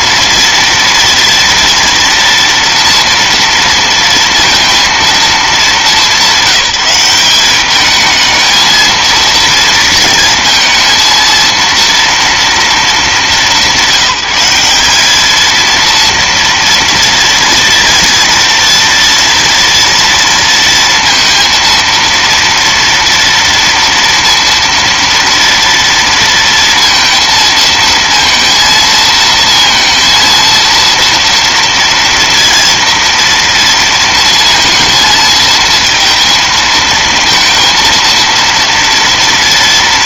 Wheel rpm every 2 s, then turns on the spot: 230, 230, 180, 210, 230, 230, 200, 230, 230, 230, 230, 230, 230, 230, 230, 230, 230, 230, 230, 230.
none